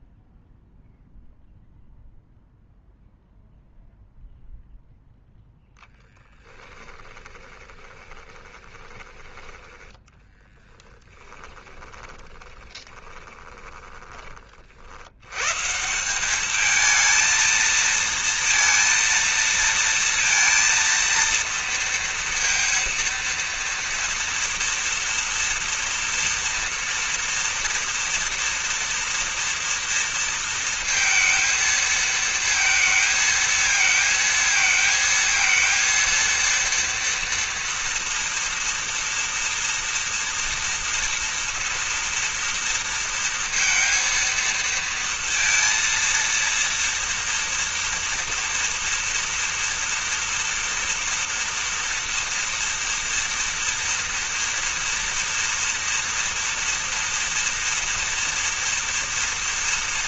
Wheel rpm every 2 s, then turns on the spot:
0, 0, 0, 10, 20, 10, 10, 40, 210, 230, 230, 230, 230, 230, 230, 230, 220, 220, 230, 230, 230, 230, 230, 230, 240, 230, 230, 230, 230, 230.
6-10 12-14